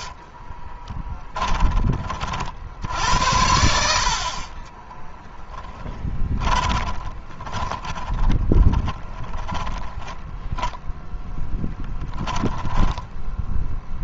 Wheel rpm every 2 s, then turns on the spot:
20, 60, 20, 20, 20, 10, 20.
0-2 4-10